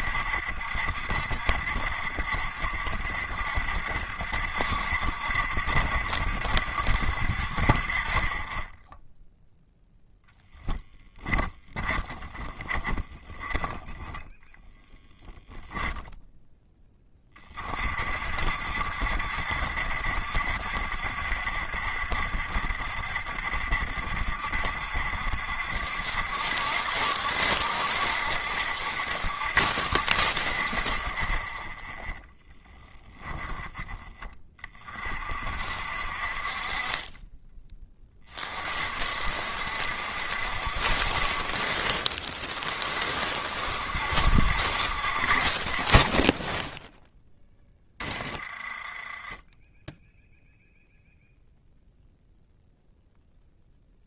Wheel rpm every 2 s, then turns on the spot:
70, 70, 70, 70, 10, 10, 20, 0, 10, 60, 70, 70, 70, 70, 70, 40, 10, 30, 40, 40, 60, 40, 60, 0, 30, 0, 0.
10-14 32-34 48-50